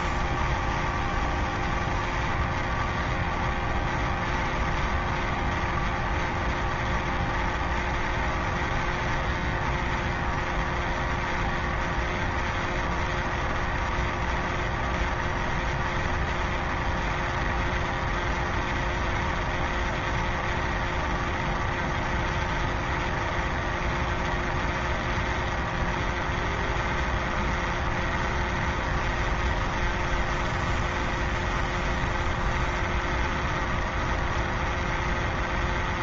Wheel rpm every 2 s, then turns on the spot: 0, 0, 0, 0, 0, 0, 0, 0, 0, 0, 0, 0, 0, 0, 0, 0, 0, 0.
none